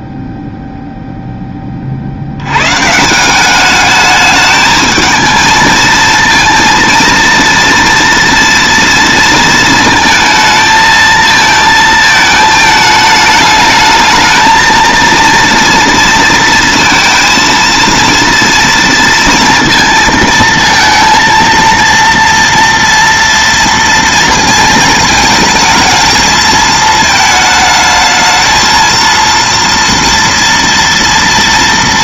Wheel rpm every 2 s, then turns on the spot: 0, 110, 210, 230, 230, 230, 220, 220, 230, 230, 230, 230, 220, 220, 220, 230.
none